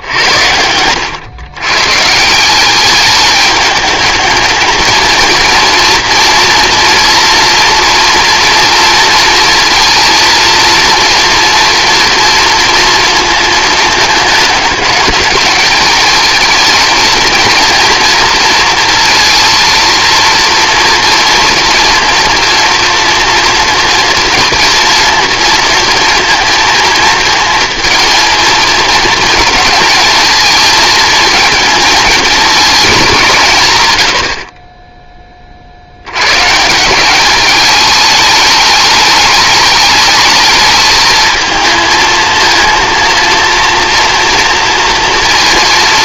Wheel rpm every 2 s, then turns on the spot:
90, 190, 220, 230, 230, 230, 230, 220, 220, 230, 230, 230, 230, 230, 230, 220, 200, 20, 160, 210, 220, 230, 230.
none